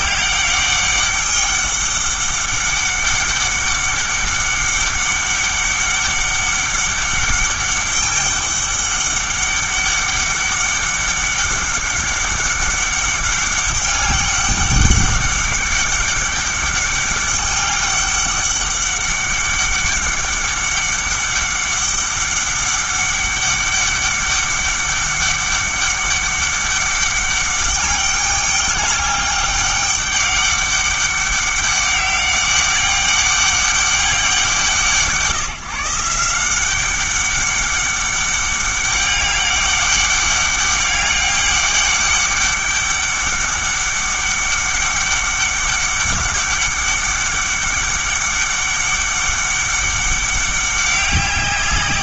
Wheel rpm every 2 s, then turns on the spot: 190, 200, 200, 200, 200, 200, 200, 200, 200, 200, 200, 200, 200, 200, 200, 200, 200, 180, 190, 200, 200, 200, 200, 200, 200, 200.
none